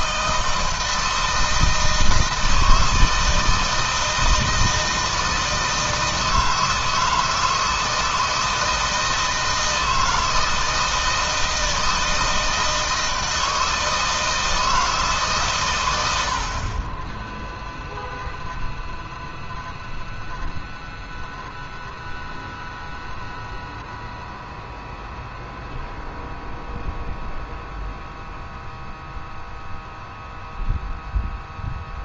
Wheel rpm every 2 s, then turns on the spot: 160, 160, 160, 160, 160, 160, 160, 150, 10, 0, 0, 0, 0, 0, 0, 0.
none